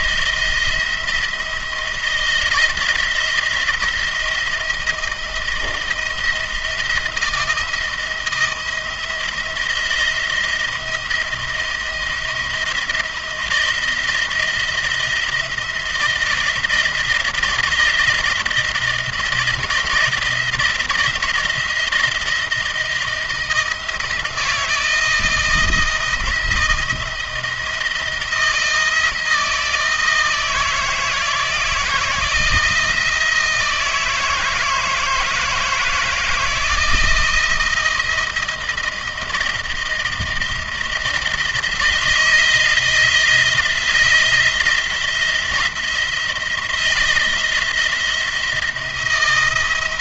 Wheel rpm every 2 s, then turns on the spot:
170, 160, 170, 170, 170, 170, 170, 170, 170, 170, 170, 170, 160, 160, 170, 160, 160, 160, 160, 170, 170, 170, 170, 170, 170.
none